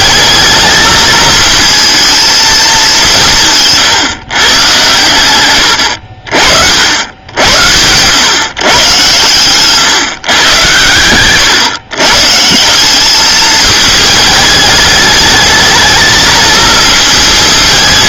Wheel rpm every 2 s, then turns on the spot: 210, 210, 120, 70, 130, 110, 190, 210, 230.
none